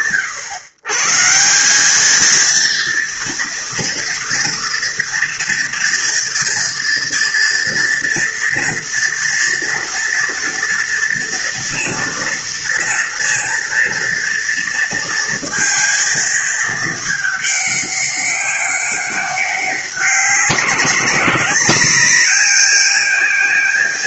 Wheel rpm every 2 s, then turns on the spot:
140, 230, 230, 230, 230, 230, 230, 230, 220, 200, 180, 210.
none